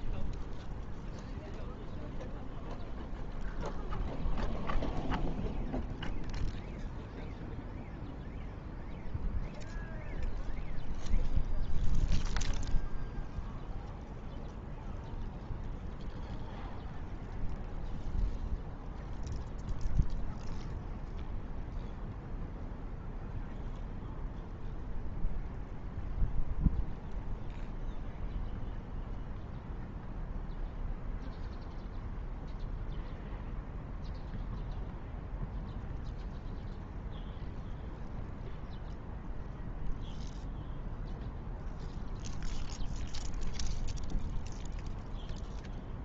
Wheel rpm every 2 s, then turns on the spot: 0, 0, 0, 0, 0, 0, 0, 0, 0, 0, 0, 0, 0, 0, 0, 0, 0, 0, 0, 0, 0, 0, 0.
none